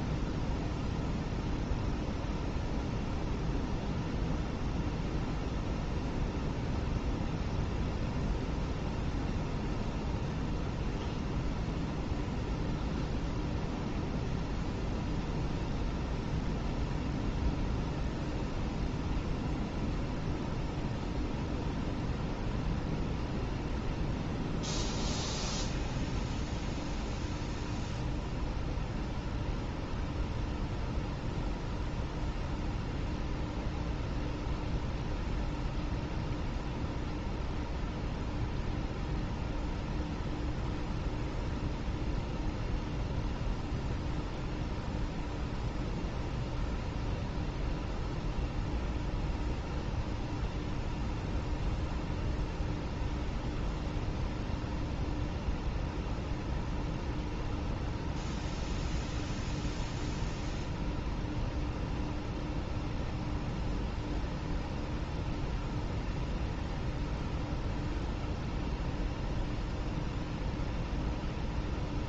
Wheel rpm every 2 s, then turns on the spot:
0, 0, 0, 0, 0, 0, 0, 0, 0, 0, 0, 0, 0, 0, 0, 0, 0, 0, 0, 0, 0, 0, 0, 0, 0, 0, 0, 0, 0, 0, 0, 0, 0, 0, 0, 0.
none